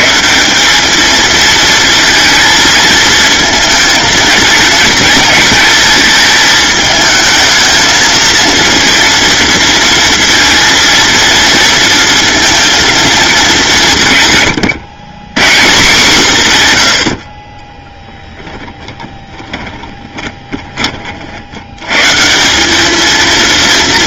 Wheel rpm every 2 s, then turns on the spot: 200, 220, 230, 220, 230, 230, 230, 120, 120, 10, 30, 200.
18-20